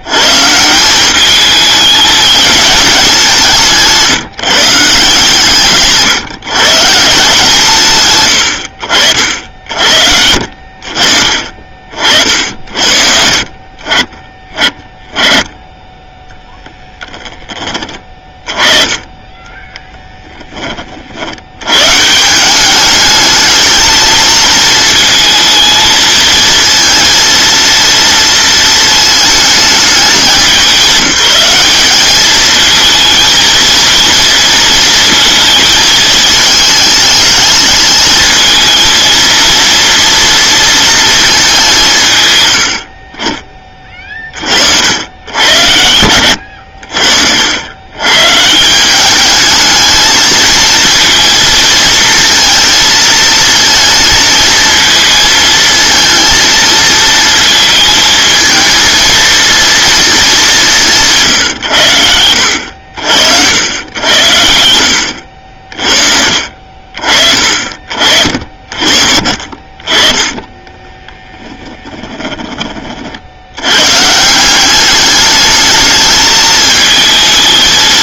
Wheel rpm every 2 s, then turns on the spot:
180, 210, 160, 160, 60, 60, 60, 20, 10, 20, 30, 200, 220, 230, 230, 190, 220, 230, 220, 230, 230, 60, 70, 70, 170, 230, 230, 230, 230, 220, 170, 70, 80, 60, 50, 10, 40, 200, 220.
16-18 70-72